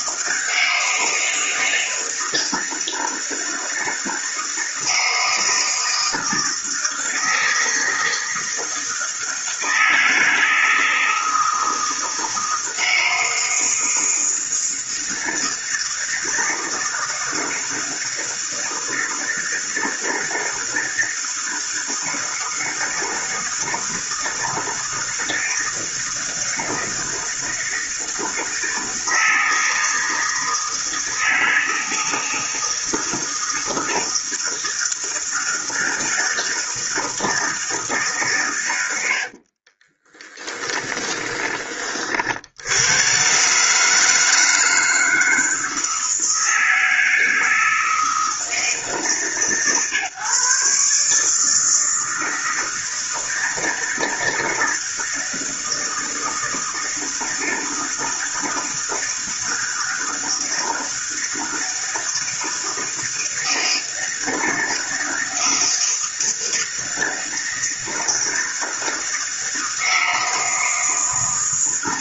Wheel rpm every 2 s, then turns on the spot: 160, 160, 160, 160, 160, 160, 160, 160, 160, 160, 160, 160, 160, 160, 160, 160, 160, 160, 160, 110, 20, 80, 160, 160, 150, 140, 160, 160, 160, 160, 160, 160, 160, 160, 160, 160.
40-42